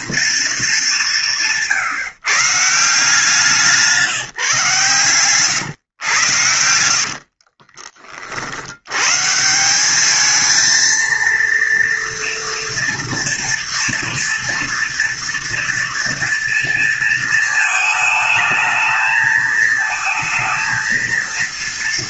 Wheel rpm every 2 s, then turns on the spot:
220, 150, 150, 90, 60, 220, 230, 230, 230, 220, 220.
6-8